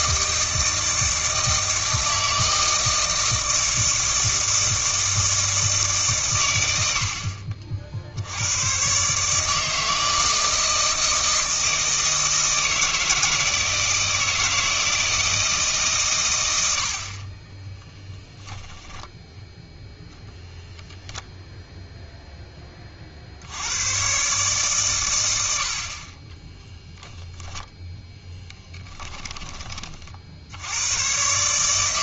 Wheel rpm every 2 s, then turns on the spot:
160, 160, 160, 80, 130, 160, 160, 160, 70, 10, 0, 30, 130, 0, 20, 100.
28-30